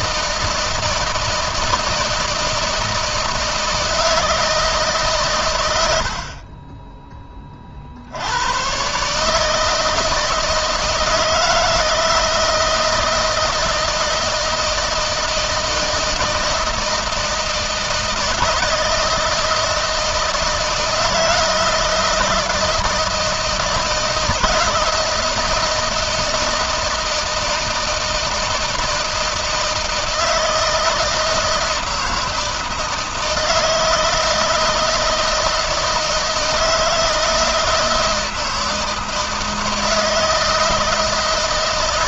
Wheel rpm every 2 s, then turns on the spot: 160, 160, 150, 30, 120, 160, 160, 160, 160, 160, 160, 170, 160, 160, 160, 160, 160, 160, 160, 160, 160.
none